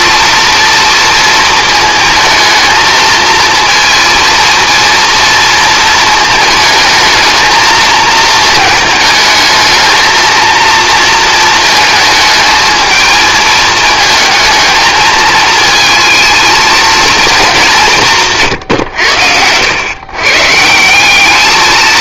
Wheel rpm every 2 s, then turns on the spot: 230, 220, 230, 220, 220, 230, 220, 220, 230, 120, 170.
none